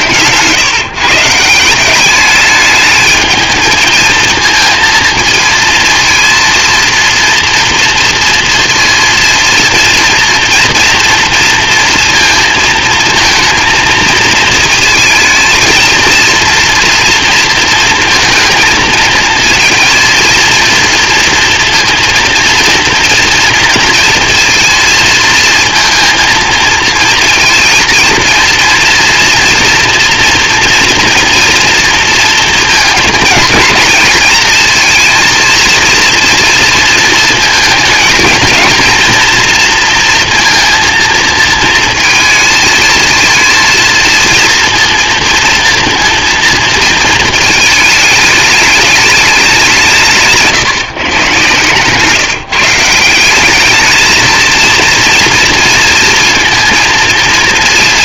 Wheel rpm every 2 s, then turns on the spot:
140, 210, 220, 230, 230, 230, 230, 230, 230, 230, 230, 230, 220, 220, 230, 240, 230, 220, 230, 230, 230, 220, 230, 220, 210, 150, 160, 230, 230.
none